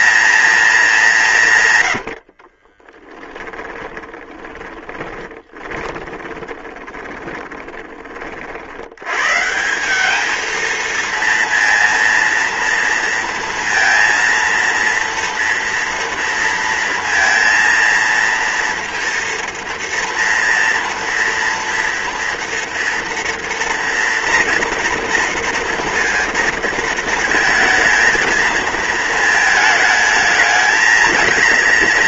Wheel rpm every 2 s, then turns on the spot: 180, 10, 20, 20, 110, 230, 230, 230, 230, 230, 230, 230, 240, 230, 220, 220.
2-8